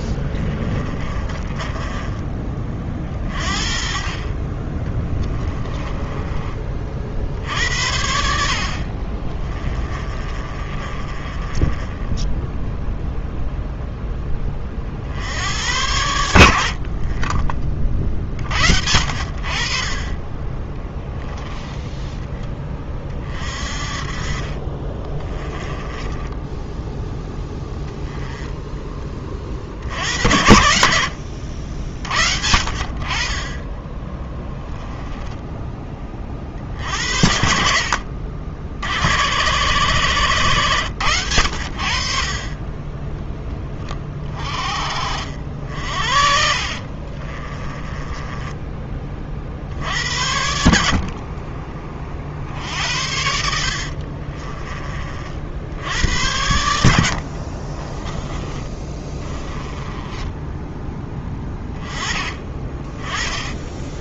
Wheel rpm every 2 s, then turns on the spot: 30, 40, 20, 40, 40, 30, 0, 50, 60, 70, 10, 30, 40, 10, 20, 80, 50, 10, 60, 80, 110, 20, 40, 50, 30, 50, 70, 30, 80, 20, 10, 20.
0-2 4-6 8-12 24-26 46-48 56-60